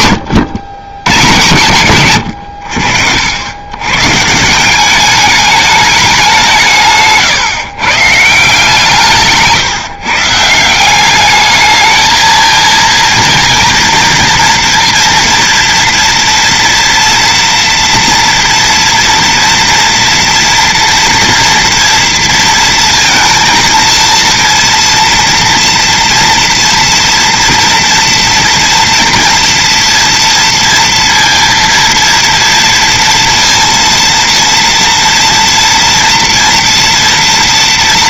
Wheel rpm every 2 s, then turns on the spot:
120, 70, 200, 140, 150, 180, 230, 230, 230, 230, 230, 230, 230, 230, 230, 230, 230, 230, 230.
none